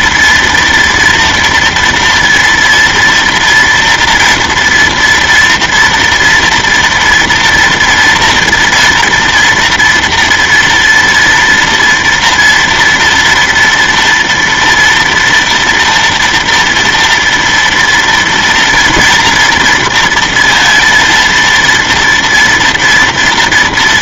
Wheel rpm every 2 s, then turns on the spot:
230, 230, 230, 230, 230, 230, 230, 230, 230, 230, 230, 230.
none